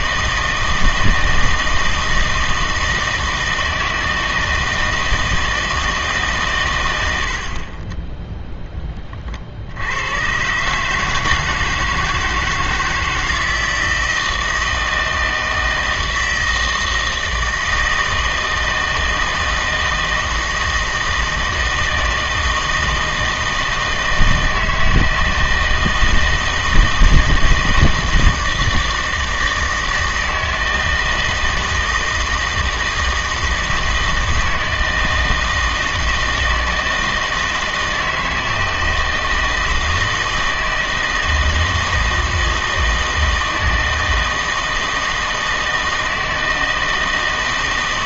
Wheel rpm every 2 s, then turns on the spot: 160, 160, 160, 110, 10, 140, 160, 160, 160, 160, 160, 160, 160, 160, 160, 160, 160, 160, 160, 160, 160, 160, 160, 160.
none